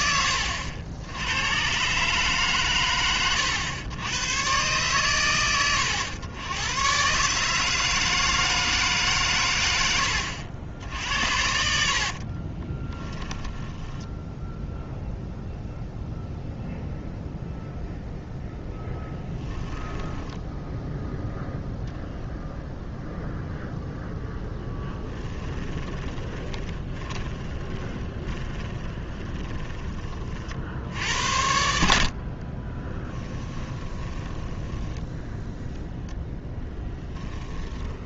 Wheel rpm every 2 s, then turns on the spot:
80, 120, 120, 120, 150, 70, 20, 0, 0, 0, 0, 0, 10, 20, 20, 70, 20, 10, 10.
12-14 24-30 32-38